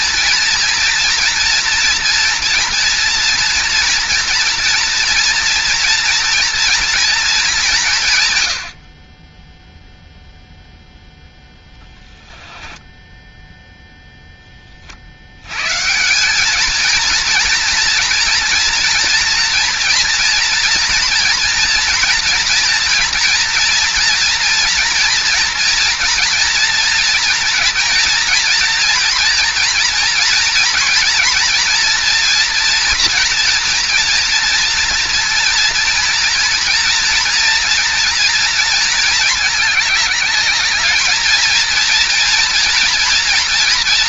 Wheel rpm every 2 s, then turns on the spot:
230, 230, 230, 230, 50, 0, 10, 10, 210, 240, 240, 240, 240, 230, 230, 230, 240, 230, 240, 230, 220, 230.
12-14